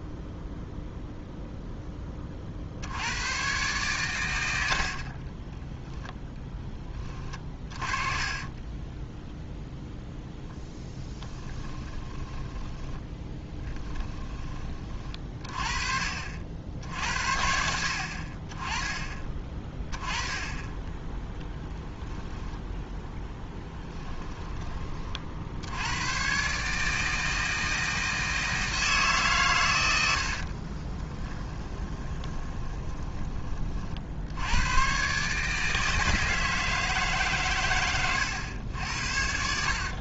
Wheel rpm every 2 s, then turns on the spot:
0, 60, 70, 10, 10, 0, 10, 20, 60, 30, 10, 0, 20, 150, 160, 40, 20, 110, 150, 80.
8-10 12-14 30-34